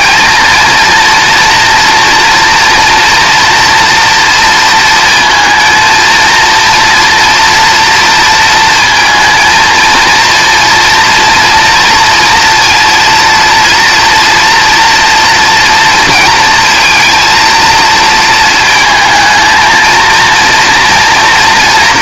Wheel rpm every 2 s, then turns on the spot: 230, 230, 230, 230, 230, 230, 230, 240, 230, 230, 230.
none